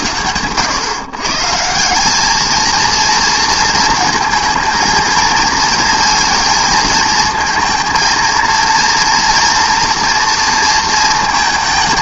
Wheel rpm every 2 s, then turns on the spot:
120, 230, 230, 230, 230, 230.
none